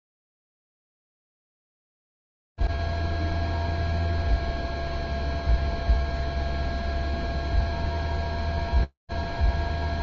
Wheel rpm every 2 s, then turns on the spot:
0, 0, 0, 0, 0.
none